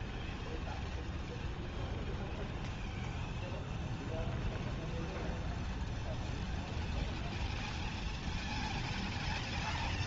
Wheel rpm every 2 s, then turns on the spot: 0, 0, 0, 0, 0.
none